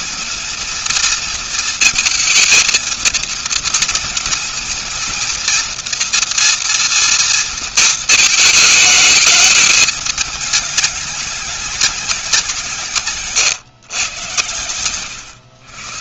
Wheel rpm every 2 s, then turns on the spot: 230, 230, 230, 240, 220, 210, 170, 110.
none